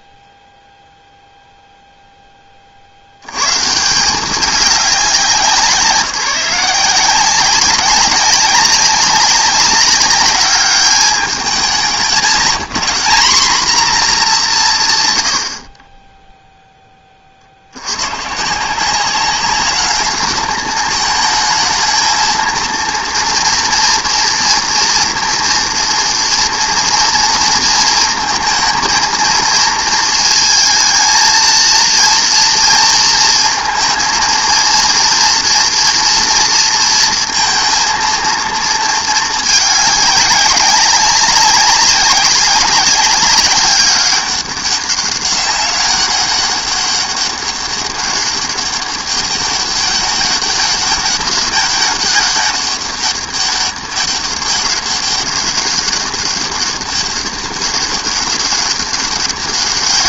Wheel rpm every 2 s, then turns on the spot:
10, 190, 170, 190, 200, 170, 200, 0, 120, 210, 230, 230, 230, 230, 220, 230, 230, 230, 230, 200, 190, 200, 200, 200, 200, 200, 200, 200, 200, 200.
none